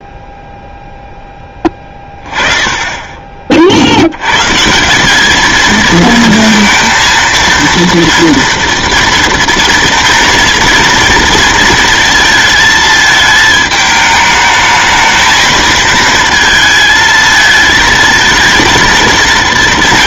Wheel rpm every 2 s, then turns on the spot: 0, 10, 170, 230, 230, 230, 220, 220, 220, 230.
none